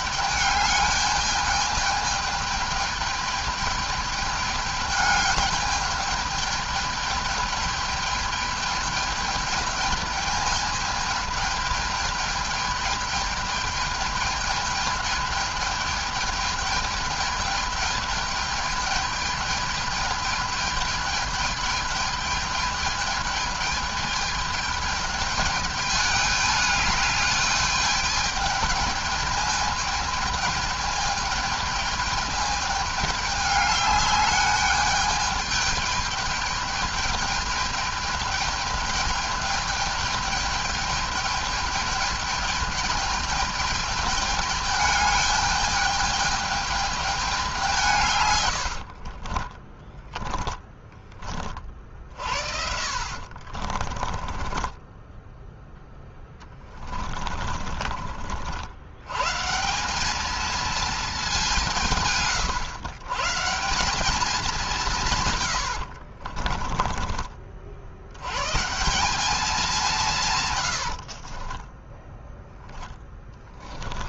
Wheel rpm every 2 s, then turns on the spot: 210, 210, 210, 210, 210, 220, 210, 210, 210, 210, 220, 210, 220, 210, 210, 210, 210, 210, 210, 210, 210, 210, 210, 210, 70, 10, 50, 20, 20, 90, 220, 110, 190, 30, 160, 100, 10.
48-50 52-58 66-68 70-72